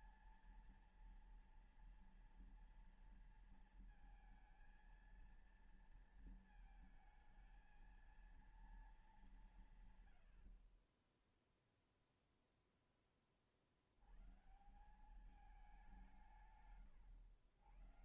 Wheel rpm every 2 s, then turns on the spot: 230, 230, 230, 230, 210, 20, 20, 180, 110.
10-12